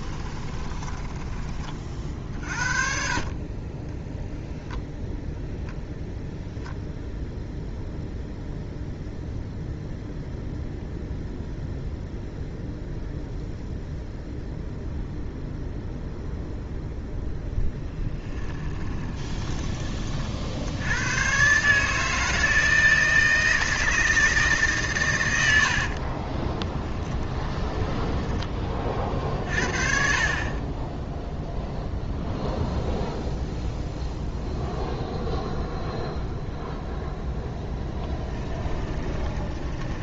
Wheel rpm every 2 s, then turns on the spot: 20, 50, 10, 0, 0, 0, 0, 0, 0, 20, 70, 160, 140, 20, 30, 20, 0, 0, 0, 20.
0-2 18-20 26-28 38-40